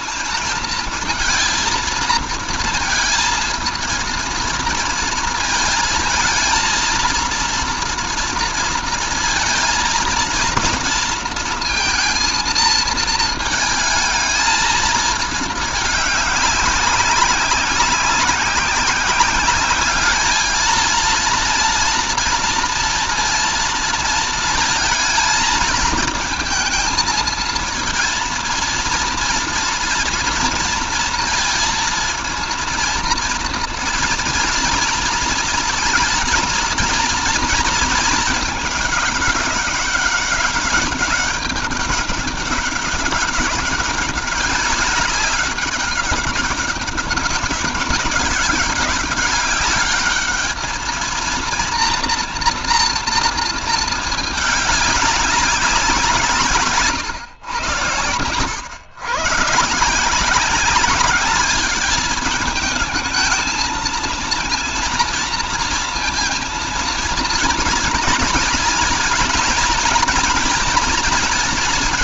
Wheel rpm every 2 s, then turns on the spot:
230, 230, 230, 230, 230, 230, 230, 220, 200, 190, 220, 230, 230, 220, 230, 230, 220, 220, 230, 210, 200, 190, 200, 200, 200, 220, 230, 210, 140, 110, 200, 220, 230, 230, 230, 230.
56-58